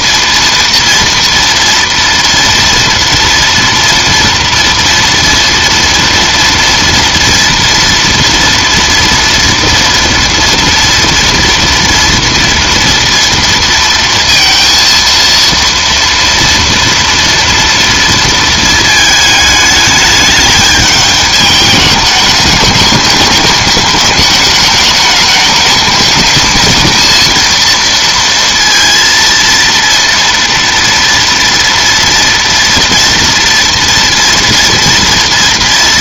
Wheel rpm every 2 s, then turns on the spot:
230, 230, 230, 230, 230, 230, 230, 230, 230, 220, 210, 200, 210, 230, 230, 230, 240, 230.
none